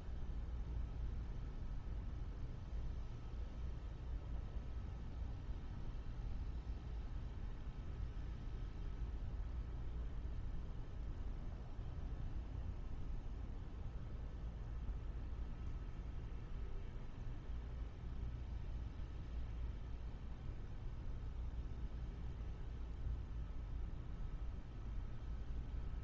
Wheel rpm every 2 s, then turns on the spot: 0, 0, 0, 0, 0, 0, 0, 0, 0, 0, 0, 0, 0.
none